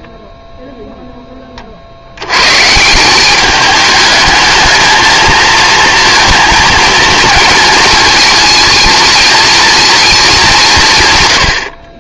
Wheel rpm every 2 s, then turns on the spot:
0, 150, 220, 230, 220, 170.
none